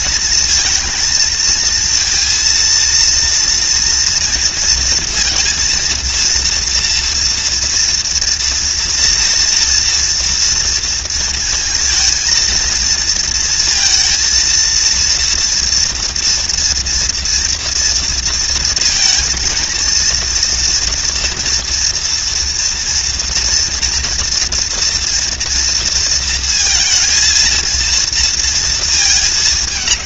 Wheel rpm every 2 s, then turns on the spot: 230, 230, 230, 240, 230, 230, 230, 230, 230, 230, 230, 230, 230, 230, 220.
none